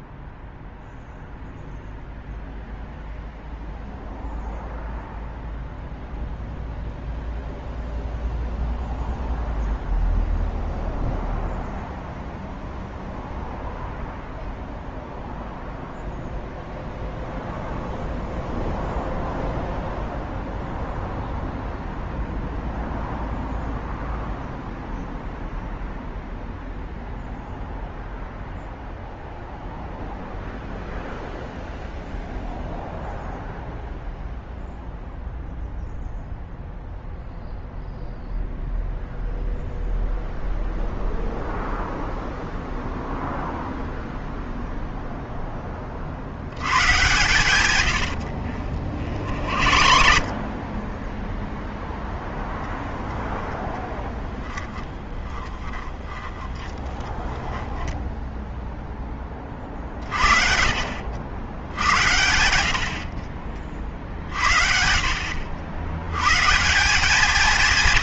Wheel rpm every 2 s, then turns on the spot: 0, 0, 0, 0, 0, 0, 0, 0, 0, 0, 0, 0, 0, 0, 0, 0, 0, 0, 0, 0, 0, 0, 0, 100, 60, 30, 0, 20, 20, 0, 50, 70, 50, 150.
48-52 54-58